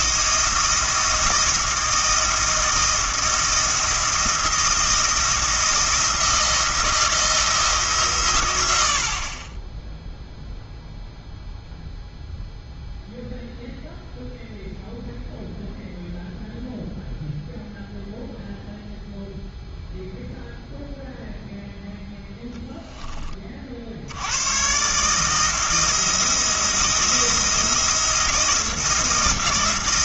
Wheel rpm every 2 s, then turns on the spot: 170, 170, 160, 160, 90, 0, 0, 0, 0, 0, 0, 0, 130, 170, 170.
none